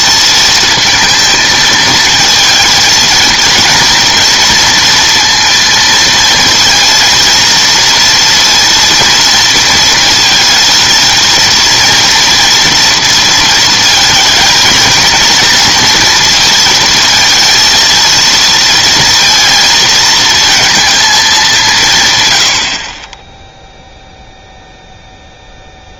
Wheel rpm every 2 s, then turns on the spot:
230, 230, 230, 230, 230, 220, 230, 220, 230, 230, 230, 80, 0.
none